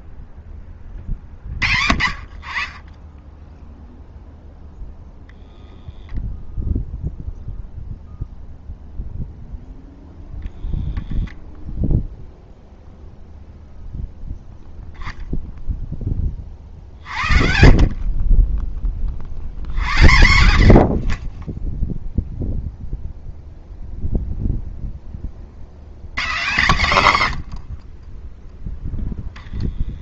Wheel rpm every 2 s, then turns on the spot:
0, 10, 0, 0, 0, 0, 30, 30, 90, 0, 0, 120, 10, 0, 0.
none